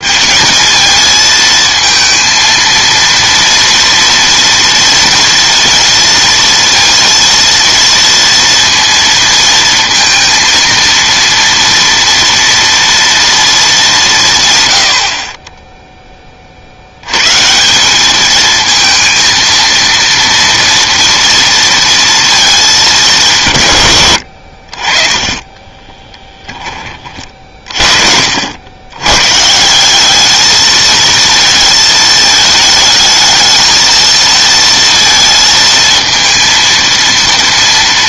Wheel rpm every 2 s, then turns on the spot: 220, 230, 240, 230, 230, 230, 230, 100, 70, 220, 230, 210, 40, 20, 90, 220, 220, 230, 230.
none